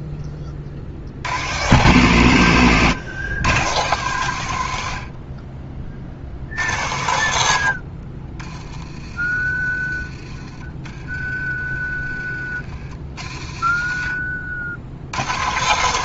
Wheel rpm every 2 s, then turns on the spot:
60, 120, 80, 90, 30, 30, 50, 70.
8-10